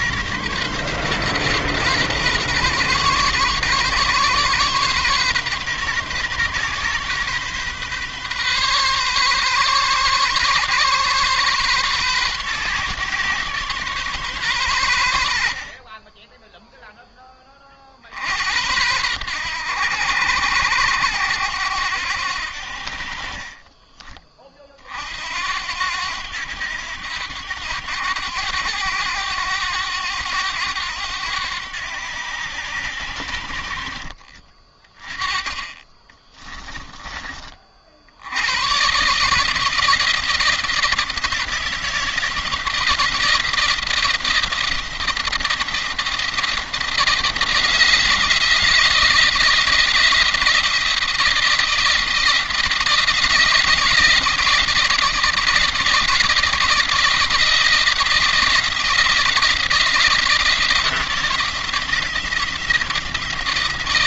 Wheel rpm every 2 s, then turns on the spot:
130, 130, 130, 130, 130, 130, 130, 110, 0, 90, 90, 60, 40, 90, 100, 90, 90, 40, 20, 110, 160, 170, 170, 160, 160, 160, 160, 170, 170, 170, 170, 160.
36-38